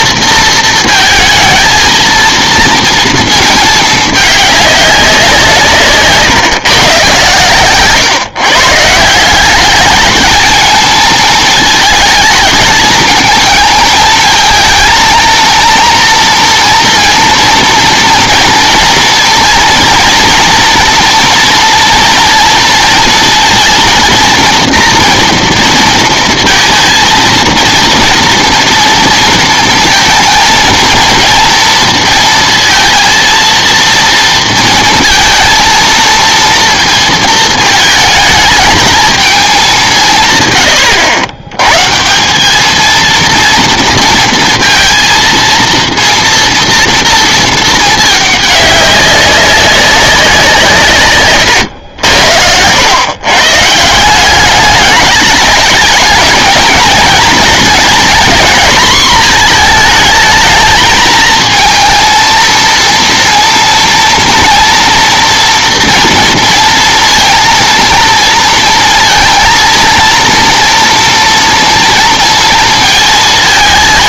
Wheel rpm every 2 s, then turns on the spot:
230, 230, 200, 140, 140, 220, 220, 220, 230, 230, 230, 230, 230, 230, 230, 230, 230, 230, 230, 220, 110, 210, 230, 230, 200, 170, 90, 200, 230, 240, 220, 230, 230, 230, 230, 230, 230.
none